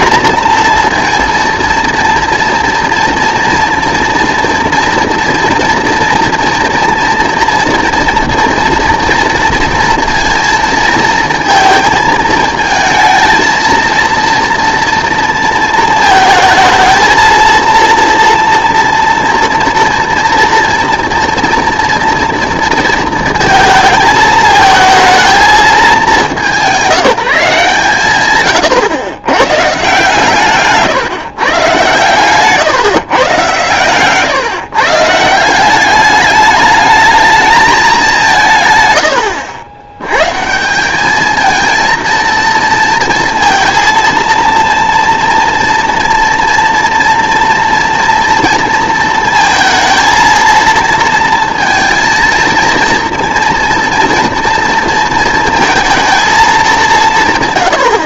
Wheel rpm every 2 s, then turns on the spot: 230, 230, 230, 230, 230, 220, 230, 230, 220, 230, 230, 230, 220, 200, 110, 140, 150, 140, 210, 140, 170, 230, 230, 230, 230, 220, 230, 230, 200.
none